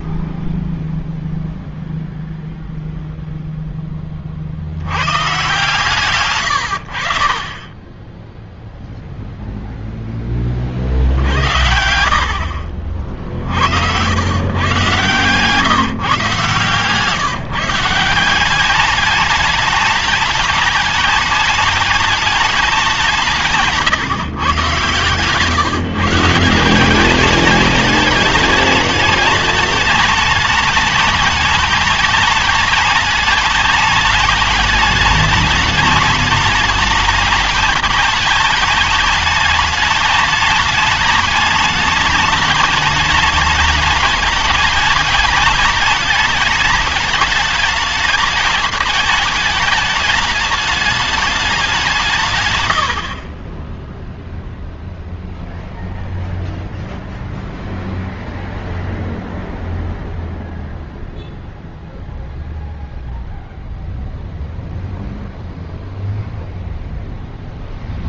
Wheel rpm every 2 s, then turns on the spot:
0, 50, 120, 0, 0, 80, 90, 150, 180, 210, 210, 150, 150, 210, 210, 210, 210, 210, 210, 210, 210, 210, 210, 210, 210, 170, 10, 0, 0, 0, 0, 0, 0, 0.
none